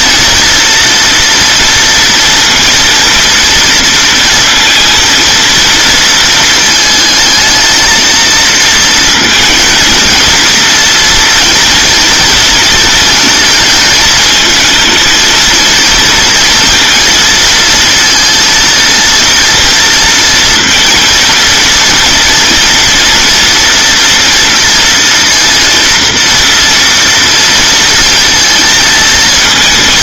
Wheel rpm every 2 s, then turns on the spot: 230, 230, 230, 220, 230, 230, 220, 230, 230, 230, 230, 240, 240, 230, 230.
none